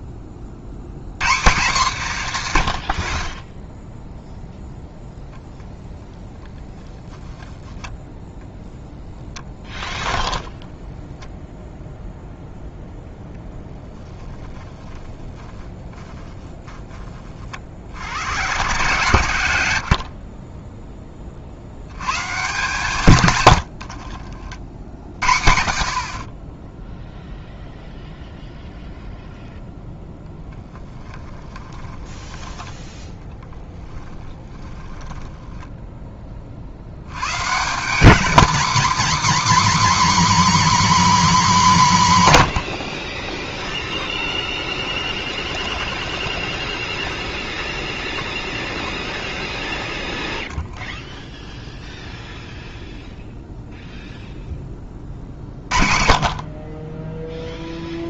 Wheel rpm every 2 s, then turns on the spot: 50, 100, 0, 10, 0, 0, 0, 10, 10, 120, 20, 140, 60, 10, 0, 20, 10, 30, 60, 250, 280, 110, 10, 10, 0, 0, 0, 10, 30.
30-32 34-36